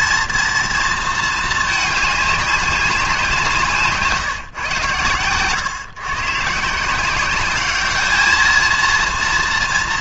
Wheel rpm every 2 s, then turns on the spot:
230, 200, 120, 160, 230.
none